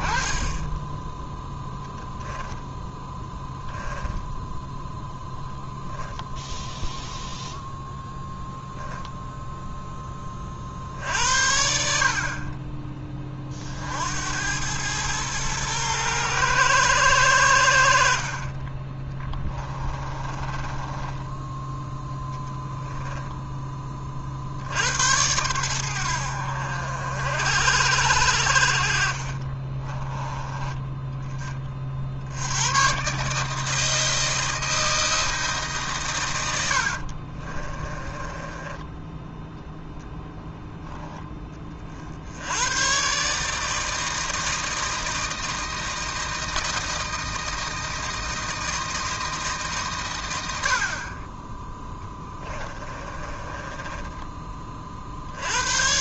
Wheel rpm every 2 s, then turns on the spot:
10, 0, 0, 0, 0, 70, 30, 110, 100, 20, 10, 10, 90, 60, 40, 10, 130, 160, 50, 10, 10, 120, 160, 160, 160, 50, 20, 50.
18-22 28-30 36-38 52-54